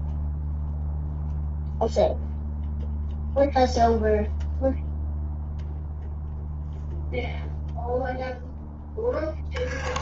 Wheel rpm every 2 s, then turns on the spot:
0, 0, 0, 0, 0.
none